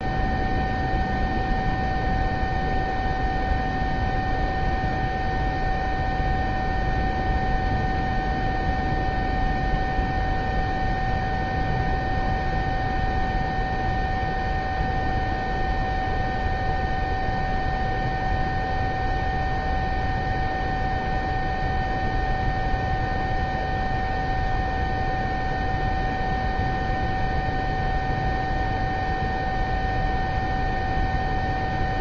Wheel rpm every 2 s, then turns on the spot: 0, 0, 0, 0, 0, 0, 0, 0, 0, 0, 0, 0, 0, 0, 0, 0.
none